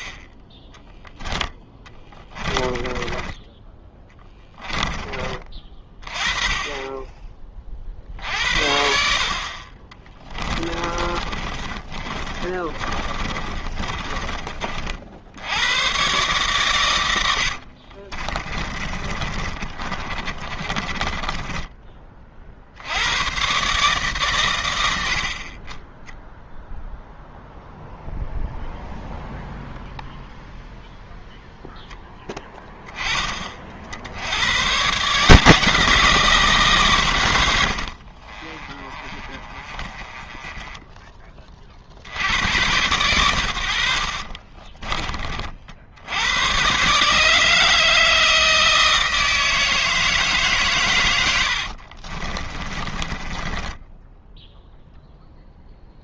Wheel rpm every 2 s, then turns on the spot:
10, 20, 20, 20, 60, 20, 30, 50, 110, 30, 30, 80, 80, 0, 0, 0, 10, 150, 140, 30, 10, 100, 30, 130, 160, 130, 20, 0.
2-4 10-14 18-22 38-42 44-46 52-54